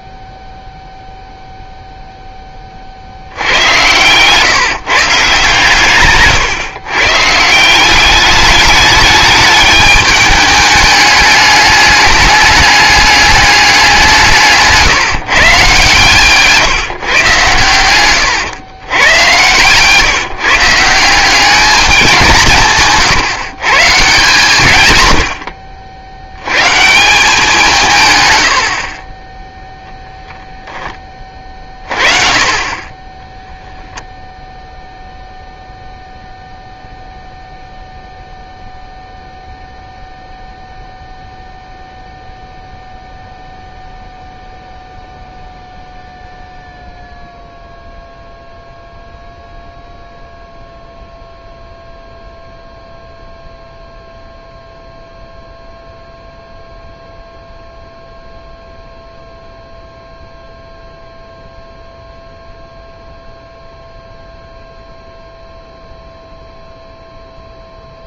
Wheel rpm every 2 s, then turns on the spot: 0, 20, 140, 130, 210, 210, 210, 150, 150, 110, 150, 160, 150, 100, 90, 0, 30, 0, 0, 0, 0, 0, 0, 0, 0, 0, 0, 0, 0, 0, 0, 0, 0, 0.
none